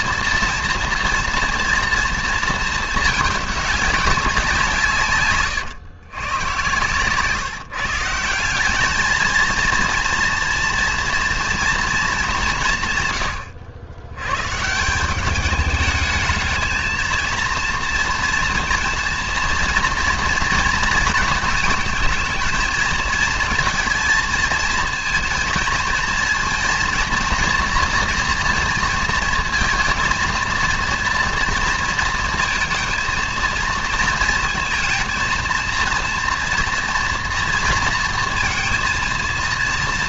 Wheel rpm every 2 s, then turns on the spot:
230, 220, 170, 120, 200, 230, 160, 150, 220, 230, 230, 220, 230, 230, 230, 230, 230, 230, 230, 230.
none